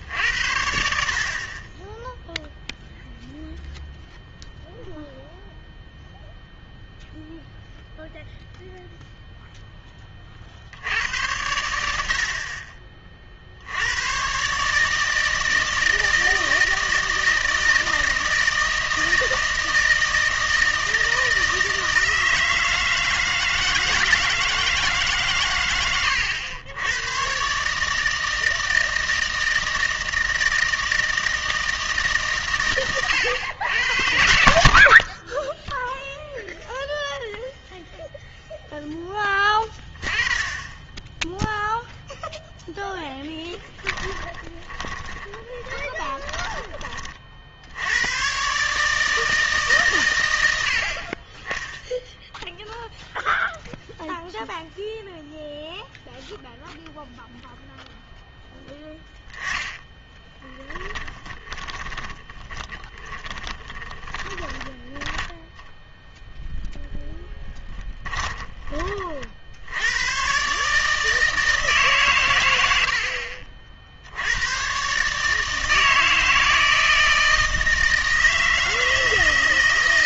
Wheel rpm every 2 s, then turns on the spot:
60, 0, 0, 0, 0, 70, 40, 150, 160, 160, 160, 160, 160, 90, 160, 160, 130, 70, 0, 10, 10, 0, 20, 30, 140, 70, 0, 0, 0, 10, 20, 20, 10, 0, 30, 150, 80, 130, 160, 160.
44-48 58-64